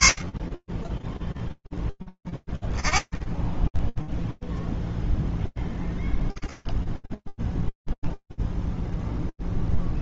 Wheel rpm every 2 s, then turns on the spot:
0, 0, 0, 0, 20.
8-10